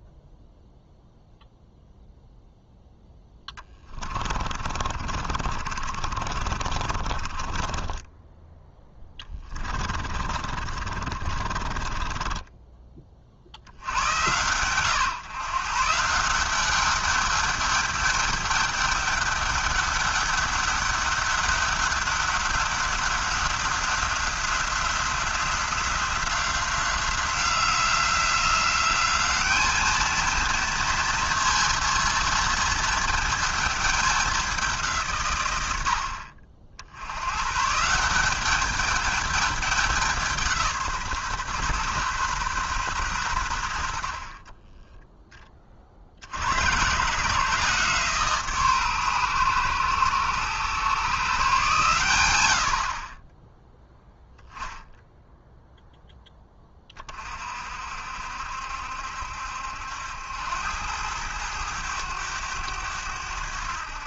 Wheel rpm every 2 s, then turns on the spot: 0, 0, 30, 30, 10, 40, 20, 120, 200, 210, 200, 190, 190, 180, 190, 230, 230, 180, 60, 210, 160, 130, 30, 100, 140, 120, 60, 0, 20, 70, 90, 100.
4-8 10-12